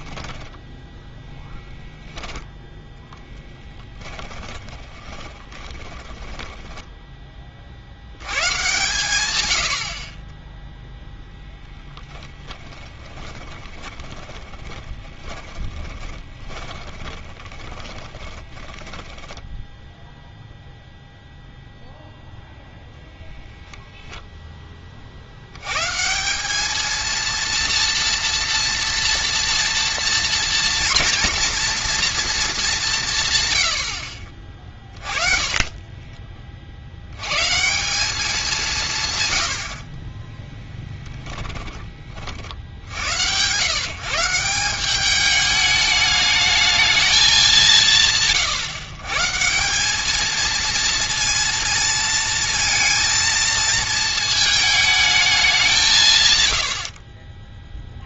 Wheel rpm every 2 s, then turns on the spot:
10, 0, 10, 10, 120, 0, 10, 20, 20, 10, 0, 0, 10, 210, 240, 240, 210, 40, 50, 180, 10, 70, 180, 220, 140, 220, 230, 220, 90.
0-2 4-8 12-20 34-36 40-42